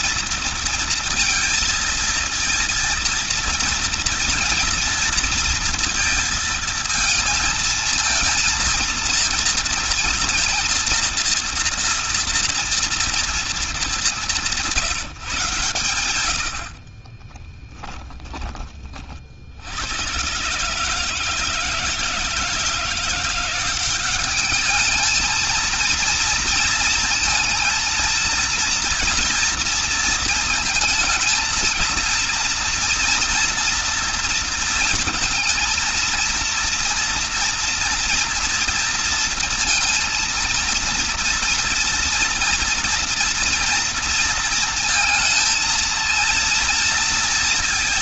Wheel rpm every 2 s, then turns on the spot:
230, 230, 240, 220, 230, 230, 240, 180, 40, 30, 150, 170, 220, 230, 230, 220, 230, 230, 230, 230, 230, 240, 220, 230.
16-18